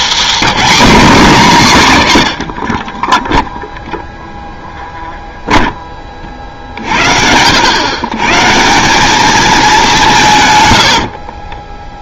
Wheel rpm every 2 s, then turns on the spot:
290, 40, 0, 50, 170, 90.
10-12